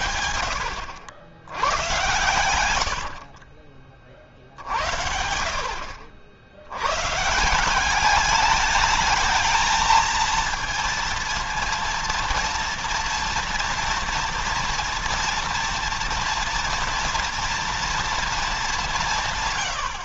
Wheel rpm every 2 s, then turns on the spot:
80, 100, 60, 90, 210, 230, 230, 230, 230, 210.
2-4